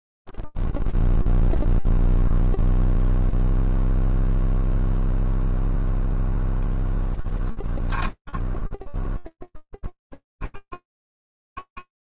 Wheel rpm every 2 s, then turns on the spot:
0, 0, 0, 0, 10, 50.
none